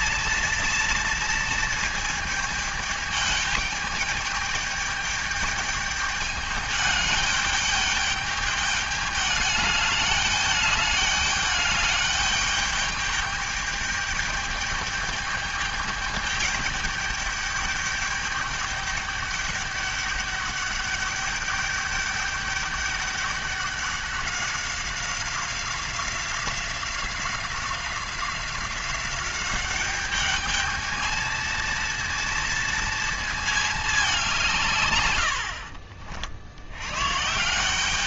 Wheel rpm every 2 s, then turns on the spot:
230, 210, 210, 210, 210, 210, 210, 210, 210, 200, 200, 200, 190, 180, 190, 220, 230, 120, 110.
none